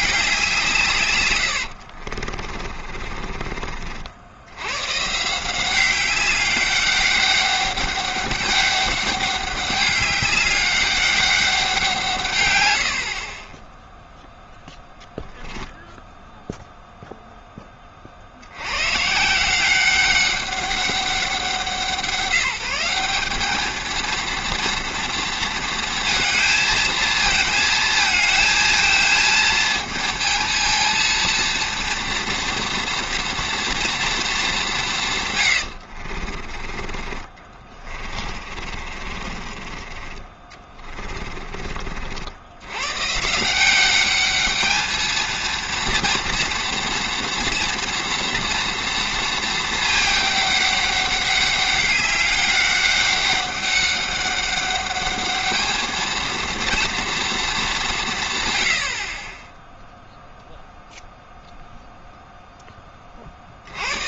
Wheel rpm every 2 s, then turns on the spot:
170, 40, 100, 200, 200, 200, 100, 0, 0, 90, 200, 180, 230, 220, 230, 230, 230, 190, 30, 40, 30, 90, 210, 230, 230, 200, 200, 200, 230, 100, 0, 10.
2-4 38-42